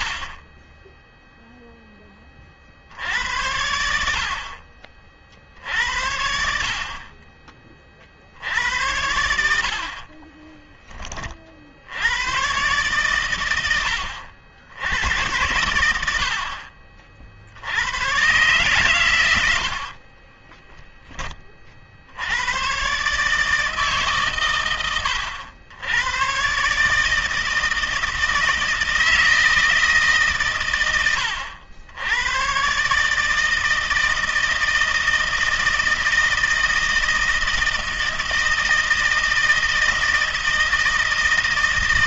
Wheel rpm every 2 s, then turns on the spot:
30, 40, 50, 60, 70, 20, 120, 80, 40, 130, 20, 100, 130, 130, 160, 130, 110, 160, 160, 160, 160.
10-12 20-22